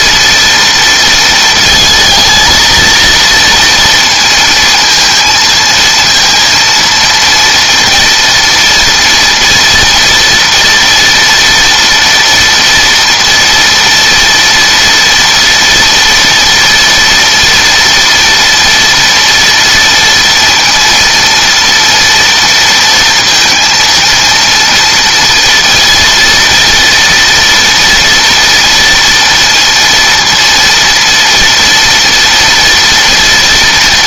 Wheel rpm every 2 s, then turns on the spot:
230, 220, 230, 230, 230, 230, 230, 230, 240, 230, 230, 230, 230, 240, 240, 230, 230.
none